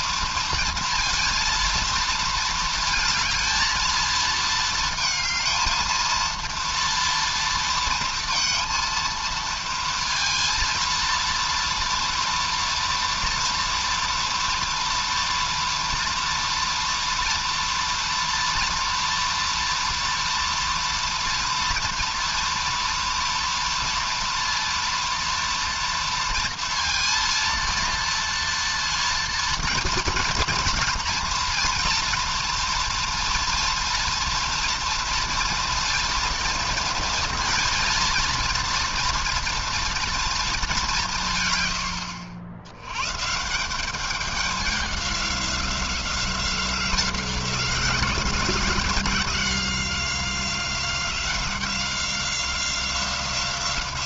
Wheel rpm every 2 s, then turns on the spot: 230, 230, 230, 230, 230, 230, 230, 230, 230, 230, 230, 230, 230, 230, 230, 230, 240, 230, 230, 230, 220, 100, 200, 180, 180, 180, 180.
none